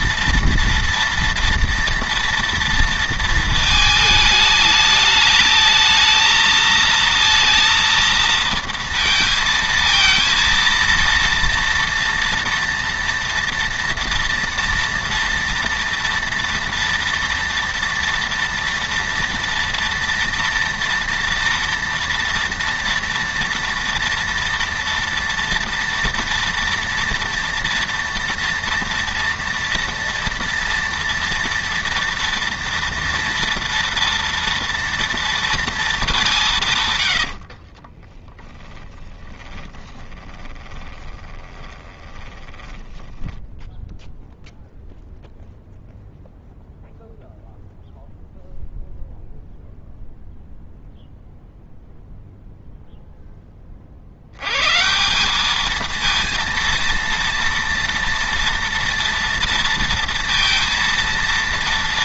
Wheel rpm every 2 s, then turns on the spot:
230, 230, 210, 220, 230, 230, 240, 230, 230, 230, 230, 230, 230, 230, 230, 230, 230, 230, 150, 10, 20, 30, 0, 0, 0, 0, 0, 120, 230, 230, 230.
38-44